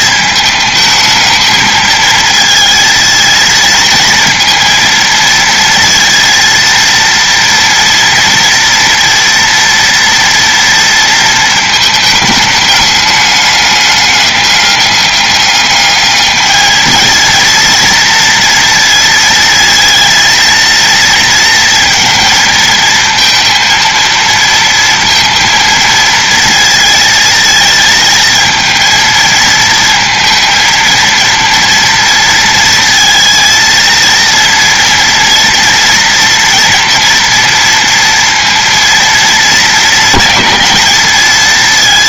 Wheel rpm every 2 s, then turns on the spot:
220, 230, 230, 230, 230, 230, 210, 200, 220, 230, 230, 230, 230, 230, 220, 230, 230, 230, 230, 230, 210.
none